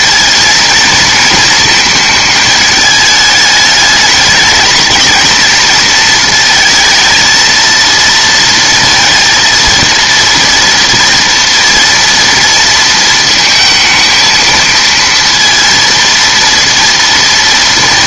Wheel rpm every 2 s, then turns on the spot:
230, 220, 220, 220, 230, 230, 230, 220, 230.
none